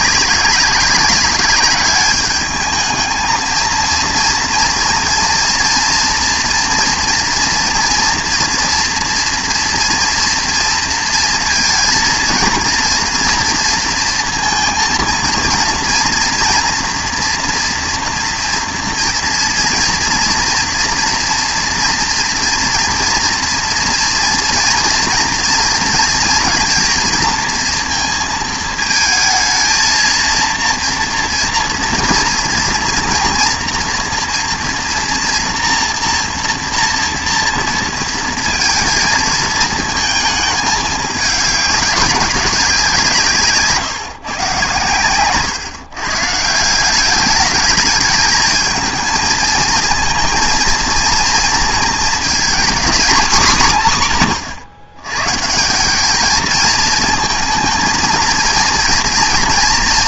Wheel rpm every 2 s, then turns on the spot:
200, 210, 230, 230, 230, 230, 230, 230, 230, 230, 230, 230, 230, 230, 220, 230, 230, 230, 230, 220, 220, 190, 130, 160, 220, 230, 240, 120, 220, 230.
none